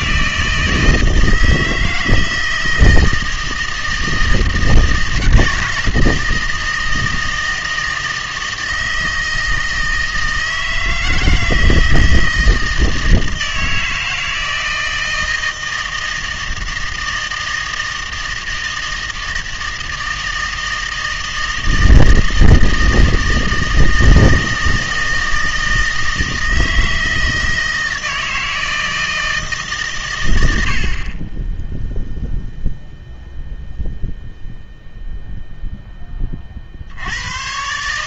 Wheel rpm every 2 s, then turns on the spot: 160, 160, 160, 160, 160, 160, 160, 160, 160, 160, 160, 160, 160, 160, 160, 80, 0, 0, 50.
none